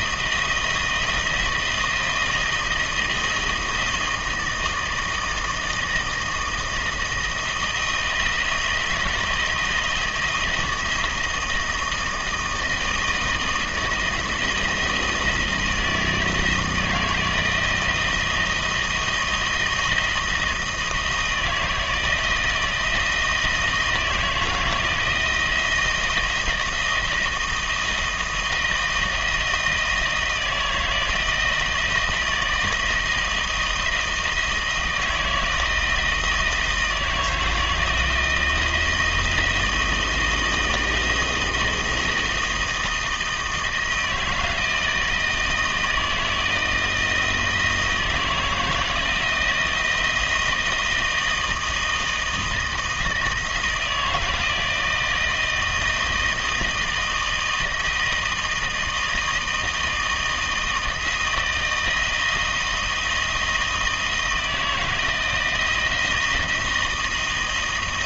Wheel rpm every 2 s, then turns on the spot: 160, 160, 160, 160, 170, 160, 160, 170, 160, 160, 160, 160, 160, 160, 160, 160, 160, 160, 160, 160, 170, 160, 160, 160, 170, 160, 160, 160, 160, 160, 160, 160, 160, 160.
none